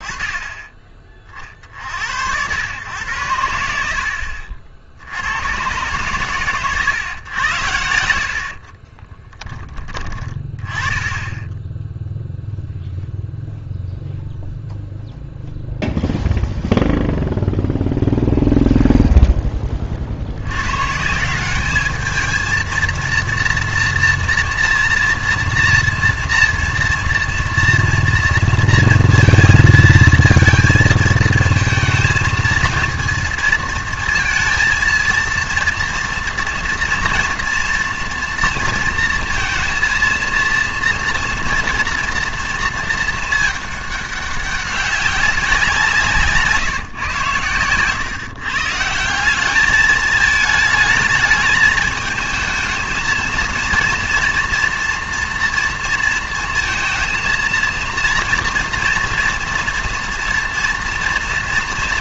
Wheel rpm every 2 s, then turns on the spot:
20, 100, 60, 120, 40, 20, 0, 0, 0, 0, 120, 230, 230, 230, 230, 230, 230, 230, 230, 230, 230, 230, 190, 150, 150, 210, 220, 230, 230, 230, 230.
8-10